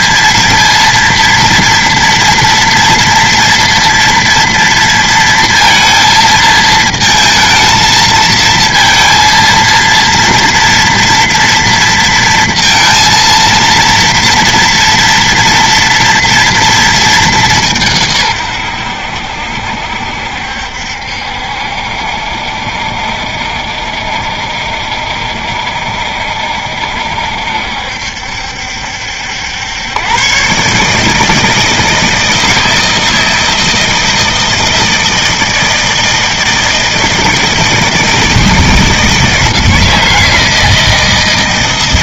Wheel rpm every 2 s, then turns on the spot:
230, 230, 230, 220, 230, 230, 230, 230, 220, 80, 70, 70, 70, 70, 70, 150, 160, 160, 160, 160, 160.
none